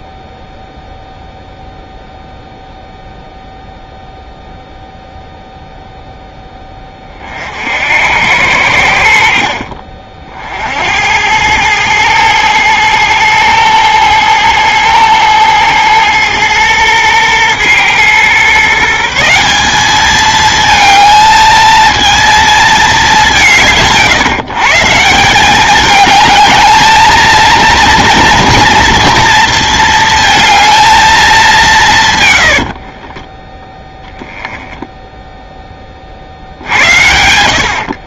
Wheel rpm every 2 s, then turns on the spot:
0, 0, 0, 10, 80, 70, 110, 110, 110, 150, 220, 220, 160, 220, 230, 230, 60, 10, 80.
32-34